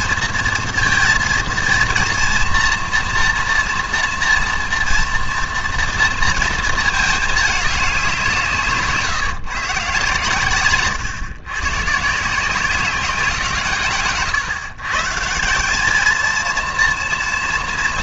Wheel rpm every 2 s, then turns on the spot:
230, 230, 240, 220, 160, 130, 170, 130, 230.
none